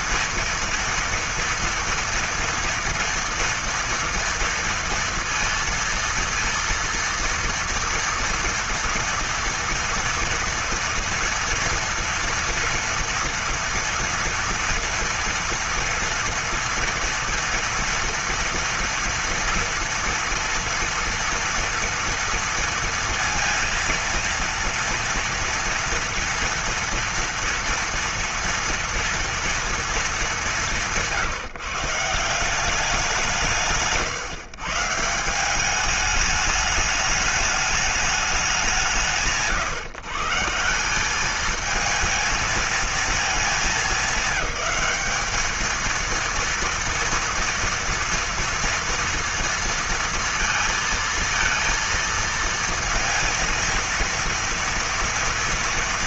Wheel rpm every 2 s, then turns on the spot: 230, 230, 230, 230, 230, 230, 230, 230, 230, 230, 230, 230, 230, 230, 230, 190, 180, 140, 210, 170, 160, 230, 200, 230, 230, 230, 230, 230.
none